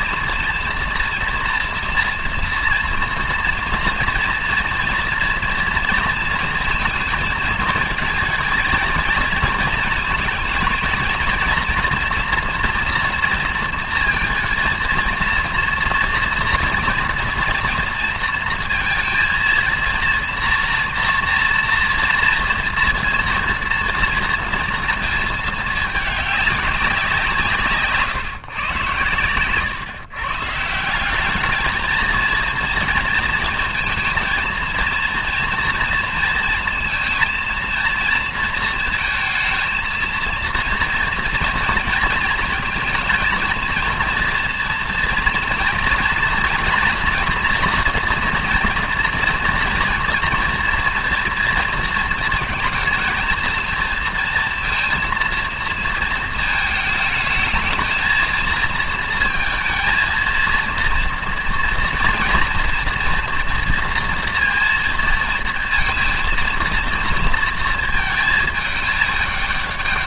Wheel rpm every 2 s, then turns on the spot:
230, 230, 230, 230, 220, 230, 240, 230, 240, 230, 230, 230, 230, 200, 140, 150, 220, 230, 230, 230, 230, 230, 240, 240, 230, 230, 230, 230, 220, 220, 230, 230, 230, 230, 220.
none